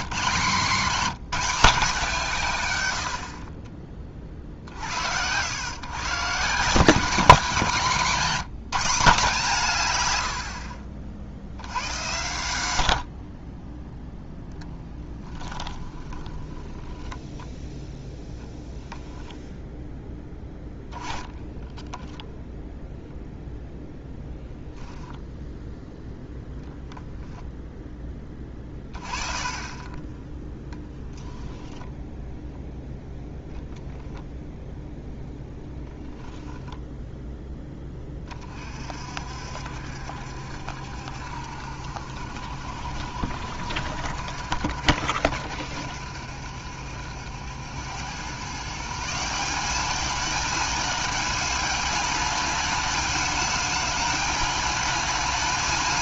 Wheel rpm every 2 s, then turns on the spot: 180, 110, 70, 180, 180, 50, 70, 10, 10, 20, 10, 0, 0, 0, 20, 0, 0, 0, 0, 50, 70, 60, 70, 70, 160, 210, 210, 220.
10-12 14-22